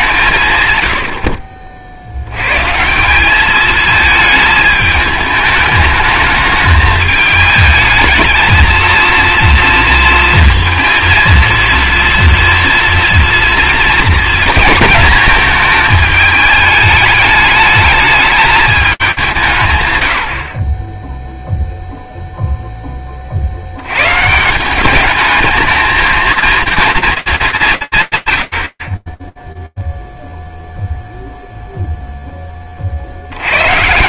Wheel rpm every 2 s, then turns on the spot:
120, 130, 220, 210, 220, 230, 240, 230, 220, 210, 50, 10, 180, 230, 110, 0, 30.
none